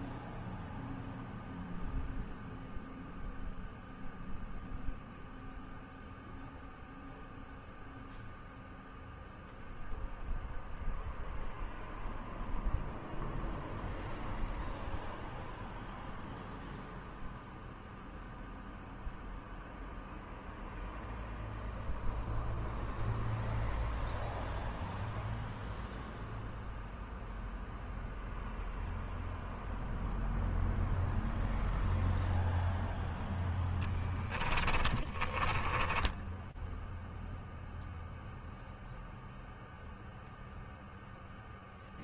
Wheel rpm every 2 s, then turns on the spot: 0, 0, 0, 0, 0, 0, 0, 0, 0, 0, 0, 0, 0, 0, 0, 0, 0, 10, 0, 0, 0.
34-36